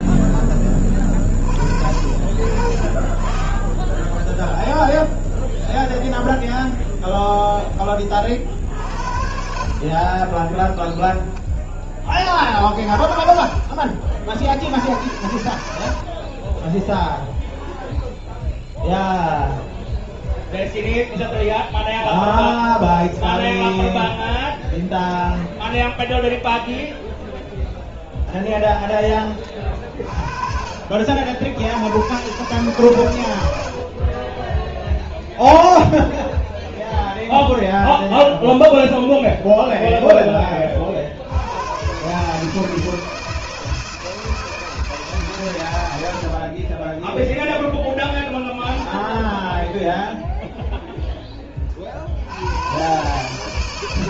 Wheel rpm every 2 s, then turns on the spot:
20, 50, 0, 0, 50, 10, 30, 80, 20, 10, 10, 10, 0, 0, 10, 50, 130, 10, 20, 20, 30, 150, 160, 30, 10, 0, 120.
10-12 16-18 22-24 34-40